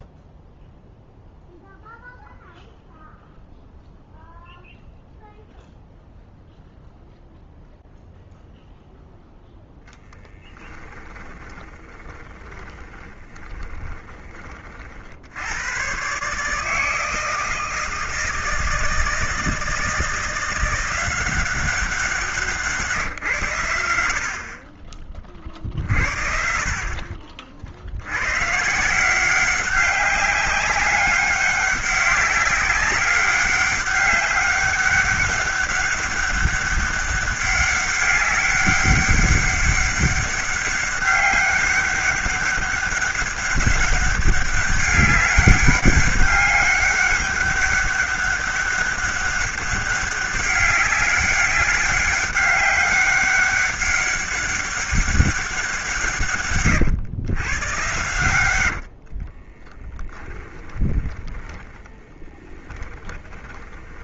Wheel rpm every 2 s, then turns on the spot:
0, 0, 0, 0, 0, 10, 20, 40, 150, 160, 170, 150, 30, 40, 150, 200, 190, 200, 200, 200, 200, 200, 200, 200, 200, 200, 200, 200, 130, 70, 20, 30.
10-14 58-64